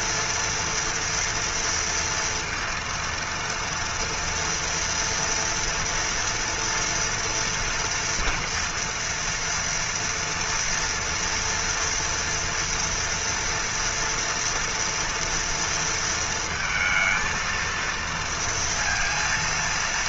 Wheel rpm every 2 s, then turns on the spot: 230, 230, 230, 230, 240, 230, 230, 240, 230, 230.
none